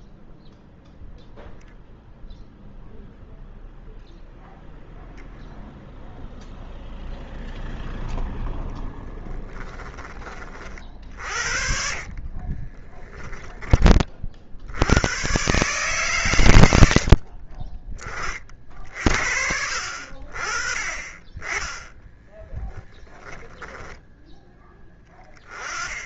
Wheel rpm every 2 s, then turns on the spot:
0, 0, 0, 0, 10, 40, 30, 70, 90, 40, 30, 20, 0.
12-14 22-24